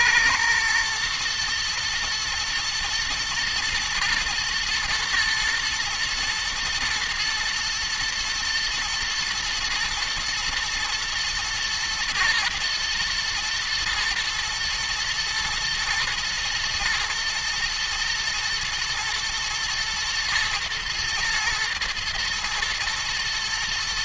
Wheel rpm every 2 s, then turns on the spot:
120, 120, 120, 110, 110, 120, 120, 110, 110, 110, 120, 120.
none